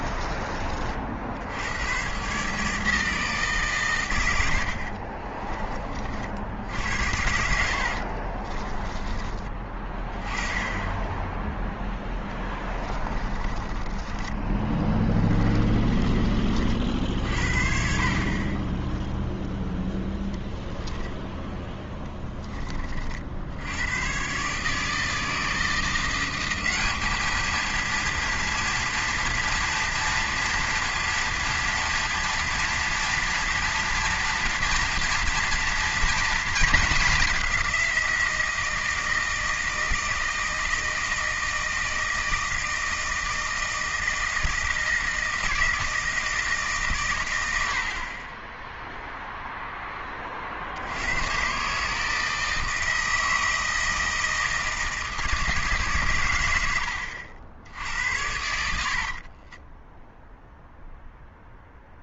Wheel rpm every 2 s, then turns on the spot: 40, 150, 80, 70, 30, 20, 10, 20, 50, 20, 0, 20, 150, 200, 230, 230, 240, 230, 220, 160, 160, 160, 160, 150, 10, 60, 160, 160, 90, 70, 0.
4-6 8-10 12-16 58-60